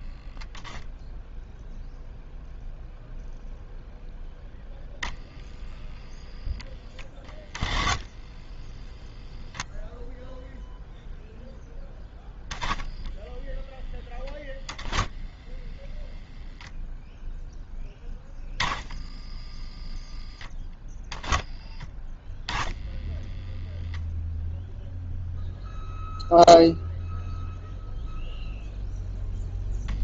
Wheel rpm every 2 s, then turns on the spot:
0, 0, 0, 10, 0, 0, 0, 0, 0, 10, 0, 0, 0, 0, 0.
none